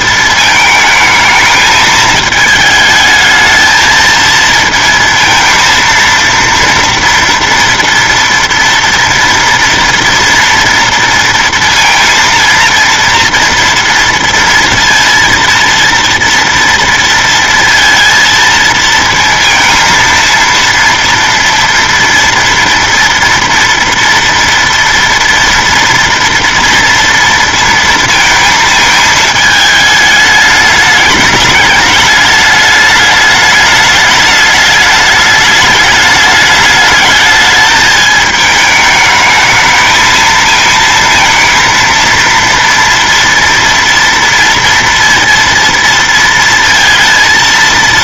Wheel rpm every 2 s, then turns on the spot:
220, 220, 230, 230, 230, 230, 230, 230, 230, 230, 230, 240, 230, 230, 220, 210, 210, 210, 220, 210, 230, 230, 230, 230.
none